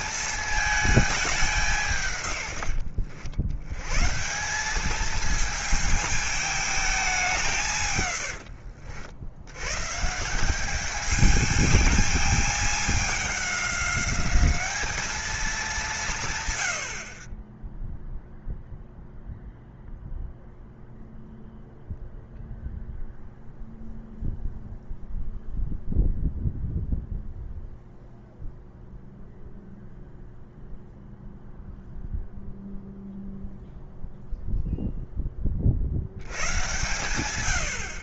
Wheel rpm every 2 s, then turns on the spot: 210, 90, 210, 210, 70, 210, 210, 210, 50, 0, 0, 0, 0, 0, 0, 0, 0, 0, 120.
none